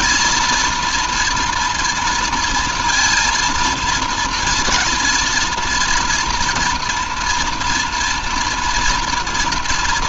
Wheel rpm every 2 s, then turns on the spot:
230, 230, 230, 240, 240.
none